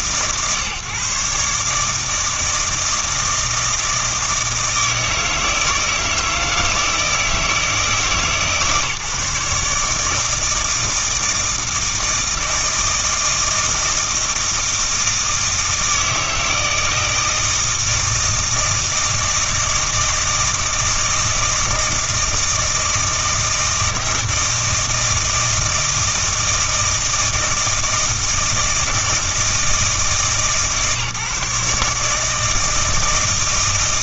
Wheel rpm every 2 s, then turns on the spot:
140, 160, 160, 160, 150, 160, 160, 160, 160, 160, 160, 160, 160, 160, 160, 150, 160.
none